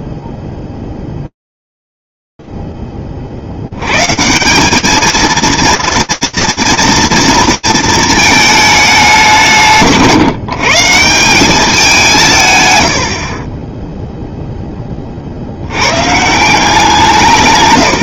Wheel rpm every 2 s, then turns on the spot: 0, 0, 90, 230, 210, 150, 110, 30, 160.
none